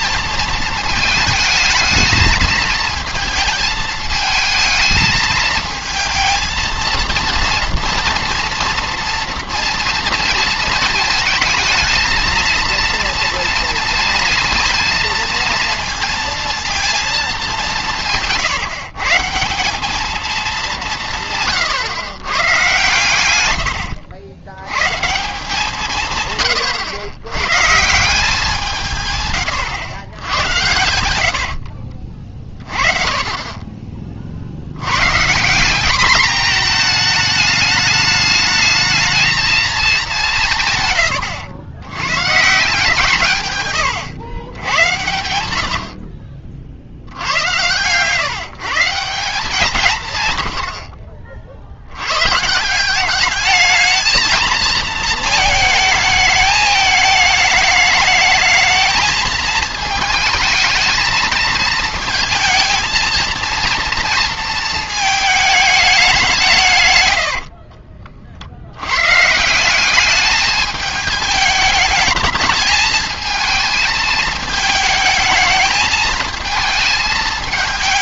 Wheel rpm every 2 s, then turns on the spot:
220, 230, 220, 230, 230, 230, 230, 230, 230, 150, 200, 120, 110, 120, 170, 90, 40, 90, 220, 220, 150, 150, 100, 60, 150, 80, 150, 220, 210, 220, 220, 220, 230, 150, 70, 210, 220, 220, 220.
none